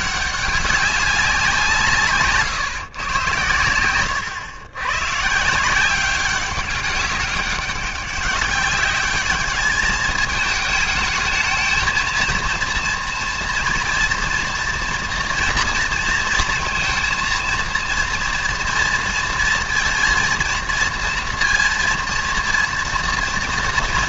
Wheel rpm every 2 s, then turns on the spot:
190, 130, 110, 190, 200, 220, 230, 230, 230, 230, 230, 230.
none